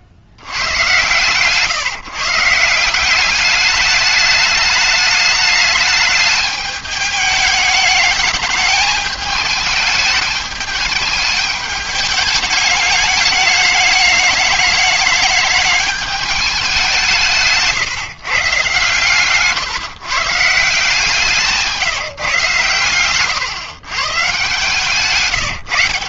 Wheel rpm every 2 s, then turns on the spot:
100, 170, 210, 210, 210, 210, 210, 210, 210, 130, 160, 140, 140.
none